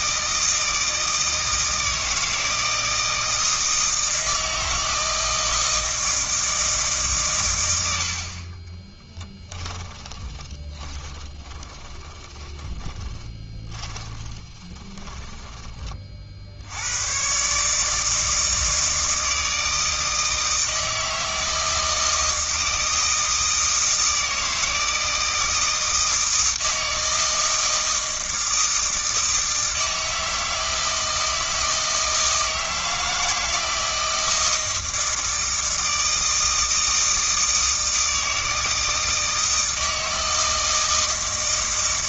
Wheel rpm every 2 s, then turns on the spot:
160, 160, 160, 150, 20, 20, 20, 20, 90, 160, 160, 160, 160, 160, 160, 160, 160, 160, 160, 160, 160.
8-16